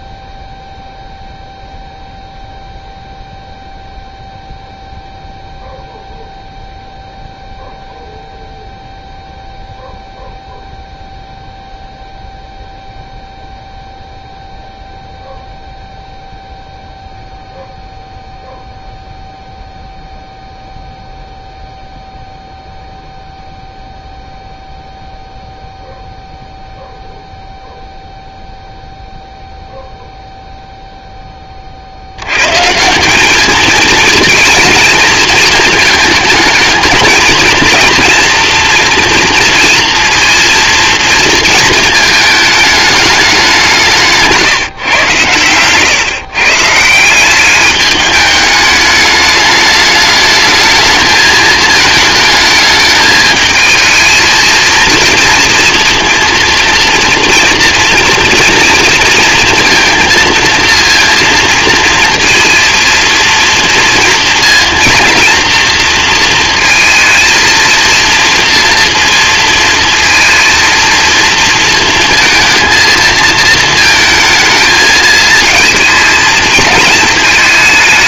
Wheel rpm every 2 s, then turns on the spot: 0, 0, 0, 0, 0, 0, 0, 0, 0, 0, 0, 0, 0, 0, 0, 0, 150, 230, 220, 240, 230, 210, 140, 150, 210, 220, 220, 230, 230, 230, 230, 230, 230, 230, 230, 230, 220, 220, 220.
none